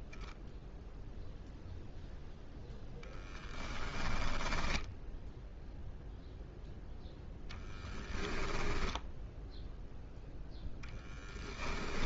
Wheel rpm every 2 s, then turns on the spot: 0, 10, 0, 10, 10, 20.
2-4 6-8 10-12